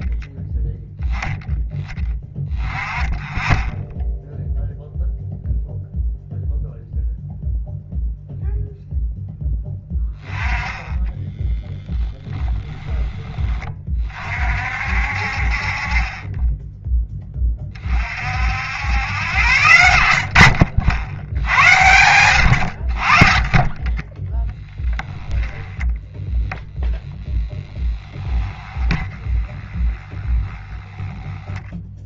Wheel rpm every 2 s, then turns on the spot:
0, 10, 0, 0, 0, 10, 10, 50, 10, 80, 60, 80, 10, 0, 20, 10.
10-12